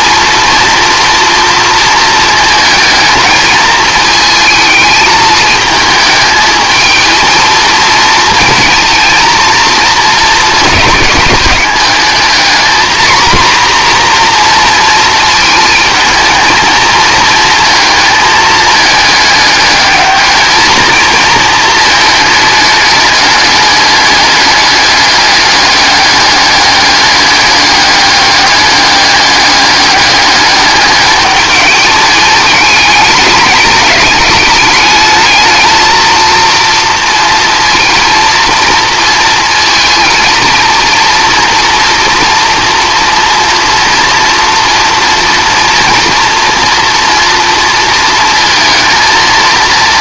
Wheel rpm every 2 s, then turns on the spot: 230, 220, 220, 220, 230, 220, 230, 240, 230, 220, 220, 220, 200, 200, 210, 210, 210, 200, 230, 230, 230, 240, 230, 240, 220.
none